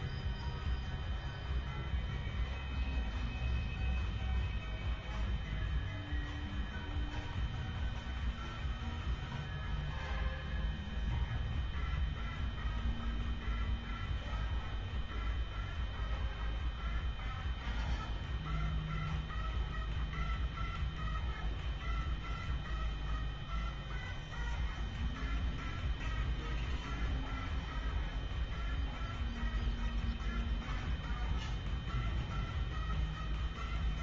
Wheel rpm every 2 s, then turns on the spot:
0, 0, 0, 0, 0, 0, 0, 0, 0, 0, 0, 0, 0, 0, 0, 0, 0.
none